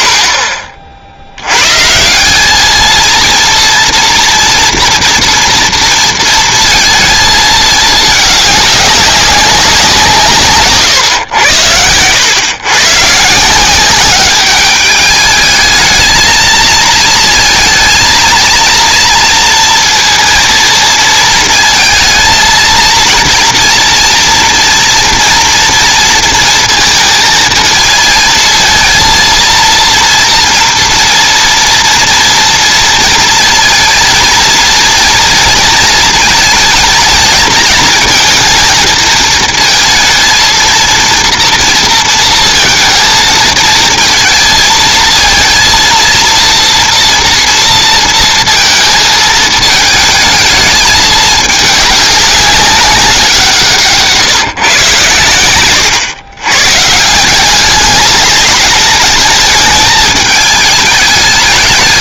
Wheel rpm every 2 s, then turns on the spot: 10, 180, 240, 230, 210, 150, 110, 200, 220, 230, 230, 230, 230, 230, 230, 230, 230, 230, 230, 230, 230, 230, 220, 230, 230, 220, 200, 160, 110, 210, 210.
none